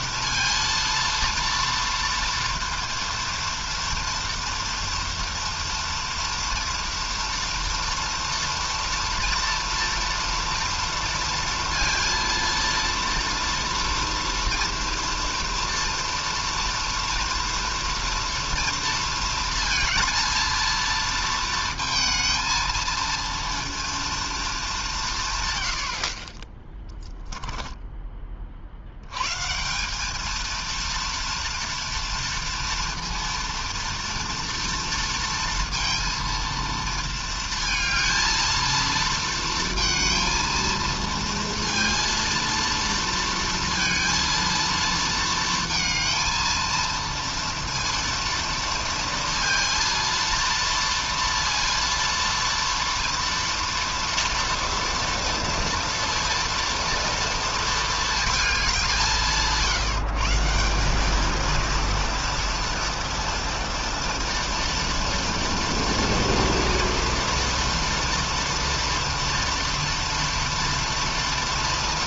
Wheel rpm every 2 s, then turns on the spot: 230, 230, 230, 230, 230, 240, 230, 230, 230, 230, 230, 230, 220, 30, 40, 220, 230, 240, 230, 230, 230, 230, 230, 230, 230, 230, 230, 230, 230, 210, 170, 230, 230, 230, 230, 230.
none